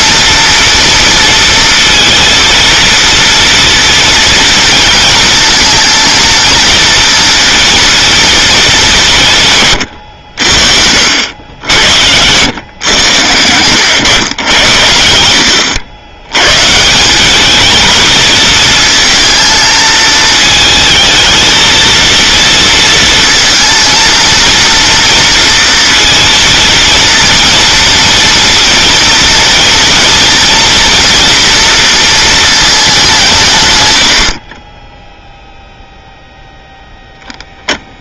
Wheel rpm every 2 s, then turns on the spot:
230, 230, 230, 230, 210, 70, 110, 90, 150, 220, 220, 230, 230, 230, 240, 230, 210, 30, 0.
none